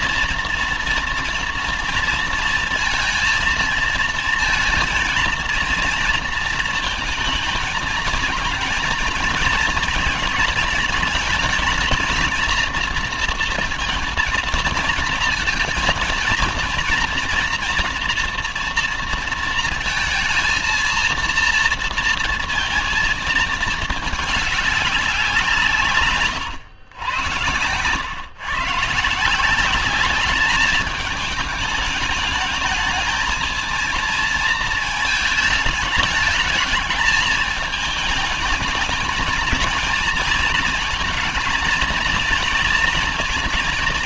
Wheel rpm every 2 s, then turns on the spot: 230, 230, 230, 230, 230, 220, 230, 230, 230, 230, 230, 230, 210, 110, 120, 210, 210, 220, 210, 220, 220, 230.
none